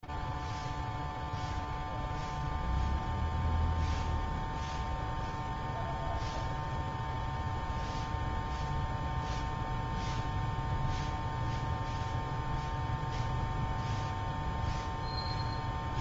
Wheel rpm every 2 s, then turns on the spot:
0, 0, 0, 0, 0, 0, 0, 0.
none